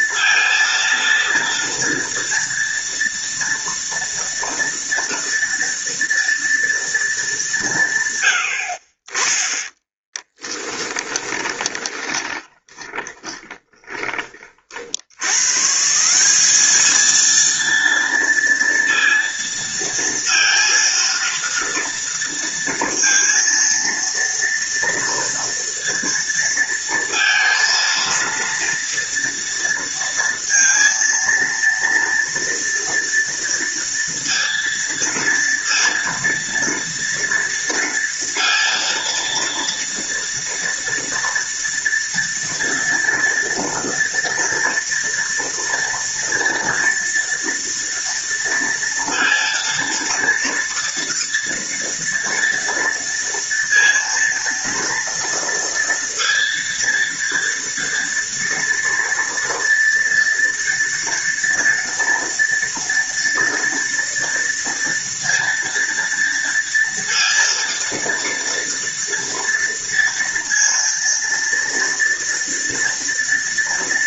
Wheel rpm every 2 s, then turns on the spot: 230, 230, 230, 230, 50, 10, 20, 70, 220, 230, 230, 230, 230, 230, 230, 230, 230, 230, 230, 230, 240, 230, 230, 240, 230, 230, 230, 230, 230, 230, 230, 240, 230, 230, 230, 230, 230.
10-14